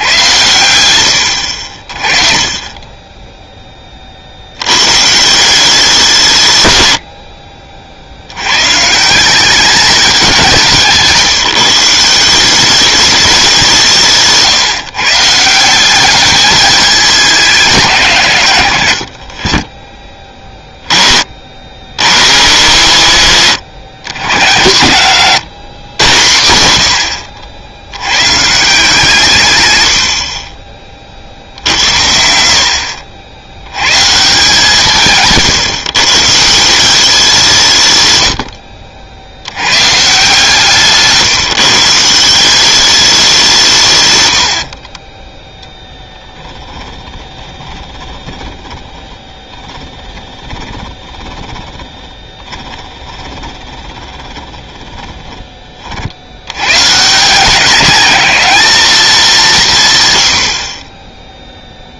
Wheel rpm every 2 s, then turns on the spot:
100, 20, 100, 110, 140, 170, 190, 150, 210, 100, 20, 130, 120, 110, 150, 30, 70, 160, 170, 70, 150, 190, 50, 20, 30, 20, 30, 10, 120, 210, 40.
38-40 44-56